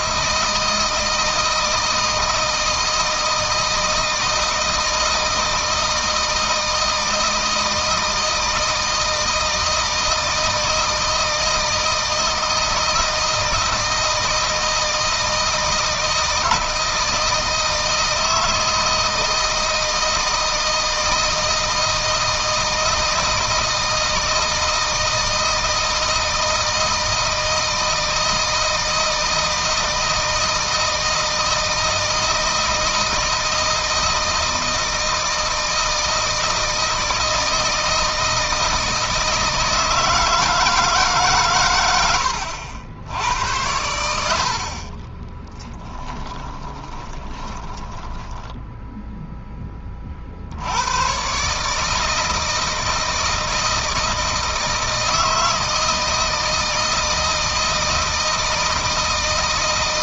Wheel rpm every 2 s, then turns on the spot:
160, 160, 160, 160, 160, 160, 160, 160, 160, 160, 160, 160, 160, 160, 160, 160, 160, 160, 160, 160, 150, 80, 60, 10, 0, 80, 160, 160, 160, 160.
46-48